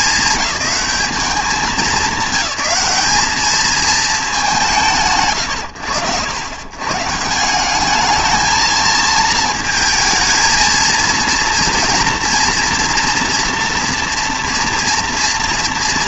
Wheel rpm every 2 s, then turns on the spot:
210, 200, 180, 100, 220, 230, 240, 230.
none